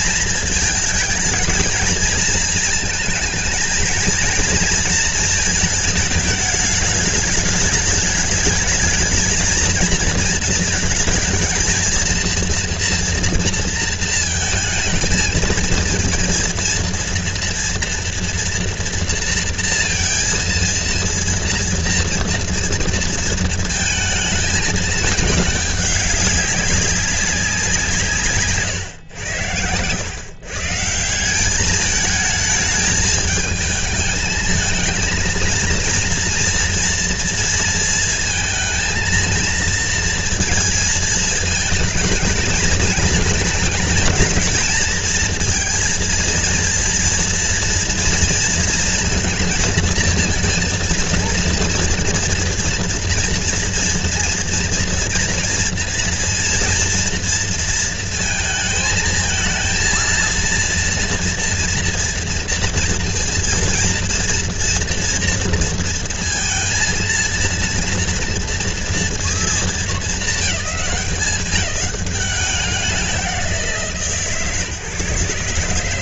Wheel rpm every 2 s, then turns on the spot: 230, 220, 230, 210, 210, 220, 230, 220, 230, 230, 230, 230, 220, 200, 120, 160, 210, 220, 230, 220, 220, 220, 230, 230, 230, 230, 230, 240, 240, 220, 230, 230, 230, 230, 230, 210, 200, 140.
none